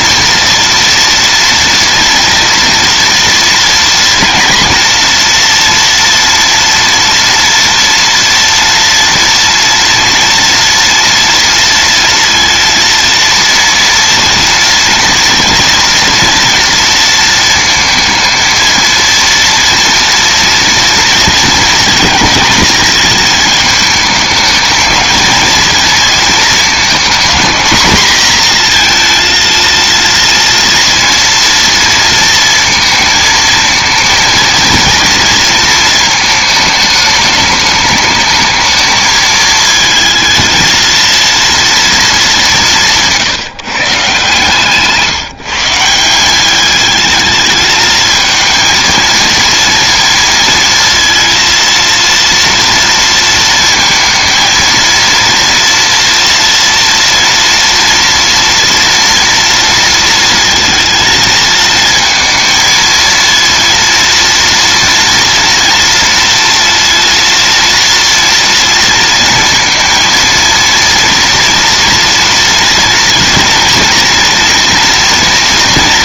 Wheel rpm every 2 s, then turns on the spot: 230, 230, 240, 230, 230, 240, 230, 230, 230, 230, 230, 220, 220, 230, 230, 230, 230, 230, 210, 220, 230, 180, 160, 210, 230, 230, 230, 230, 230, 230, 220, 230, 230, 230, 230, 230, 230, 230.
none